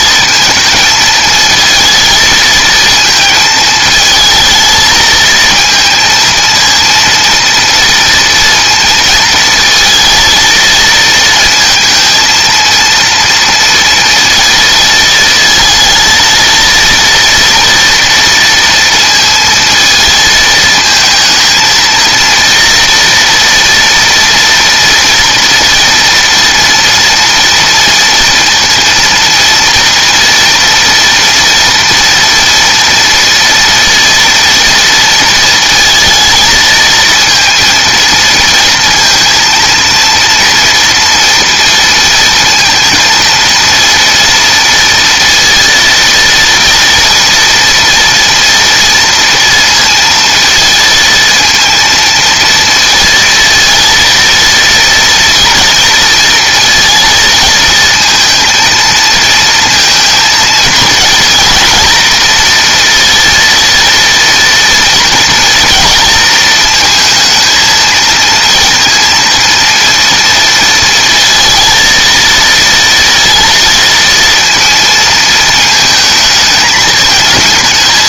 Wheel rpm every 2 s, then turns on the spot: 220, 220, 220, 230, 230, 230, 230, 230, 230, 230, 220, 230, 240, 230, 230, 230, 230, 230, 220, 230, 230, 230, 230, 230, 230, 230, 230, 230, 230, 230, 220, 230, 230, 230, 230, 230, 230, 230, 220.
none